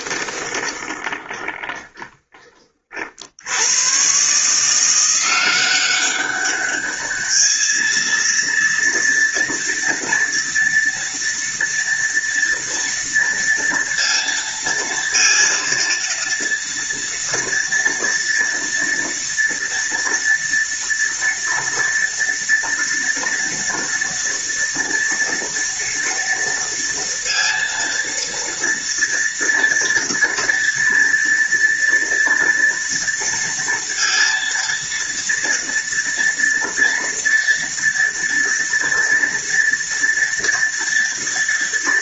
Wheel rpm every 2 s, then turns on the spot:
20, 30, 170, 210, 230, 230, 230, 230, 230, 230, 230, 230, 230, 230, 230, 230, 230, 230, 230, 230, 240.
0-2